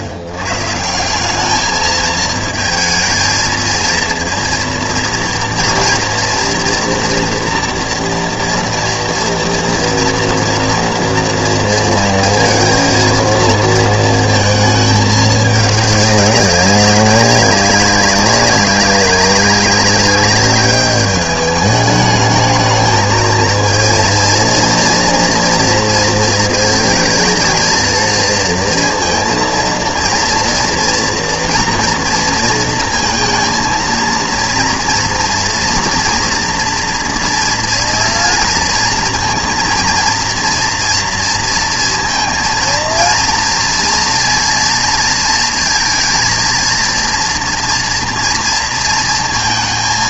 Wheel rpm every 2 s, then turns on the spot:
100, 220, 230, 230, 230, 230, 230, 220, 200, 190, 200, 220, 230, 220, 230, 240, 230, 230, 230, 230, 230, 230, 240, 230, 230.
none